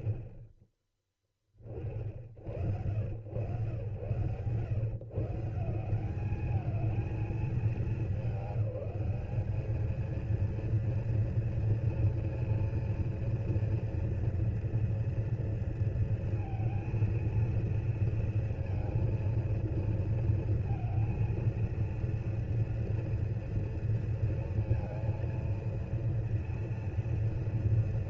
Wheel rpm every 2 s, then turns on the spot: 30, 90, 180, 210, 210, 230, 230, 230, 230, 230, 230, 230, 230, 230.
none